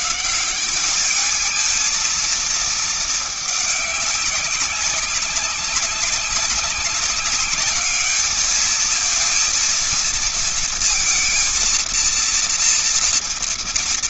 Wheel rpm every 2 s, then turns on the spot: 170, 220, 200, 200, 210, 230, 230.
none